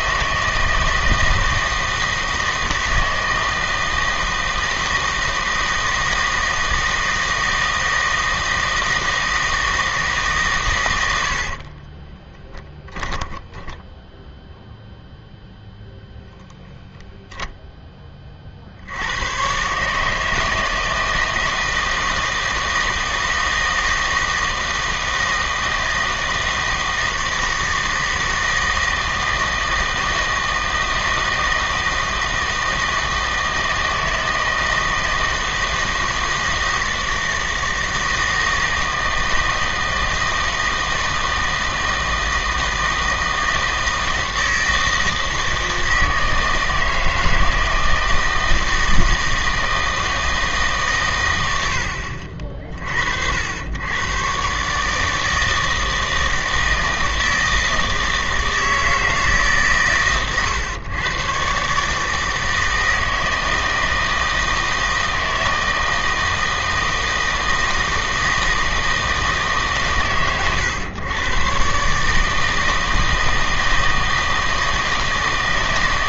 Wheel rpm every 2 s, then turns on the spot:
160, 160, 160, 160, 160, 120, 10, 0, 10, 60, 160, 160, 160, 160, 160, 160, 160, 160, 160, 160, 160, 160, 160, 160, 160, 150, 50, 140, 160, 160, 120, 160, 160, 160, 160, 110, 160, 160.
12-14